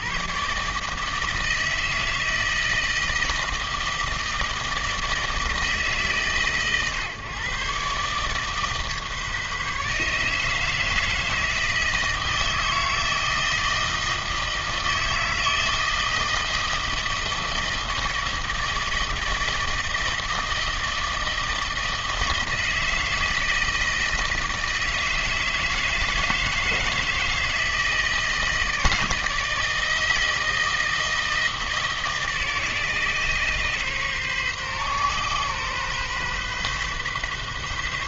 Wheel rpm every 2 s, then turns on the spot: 140, 160, 160, 150, 150, 160, 160, 160, 160, 160, 160, 160, 160, 160, 160, 170, 140, 130, 130.
none